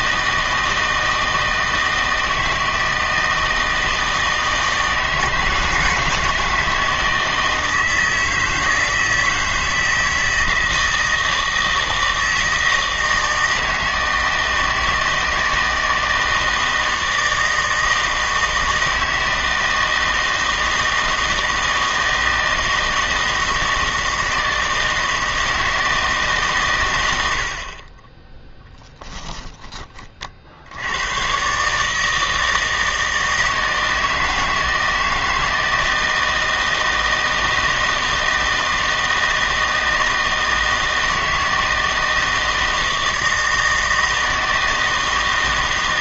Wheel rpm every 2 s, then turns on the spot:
160, 160, 160, 160, 160, 160, 160, 160, 160, 160, 160, 160, 160, 130, 10, 90, 160, 160, 160, 160, 160, 160, 160.
none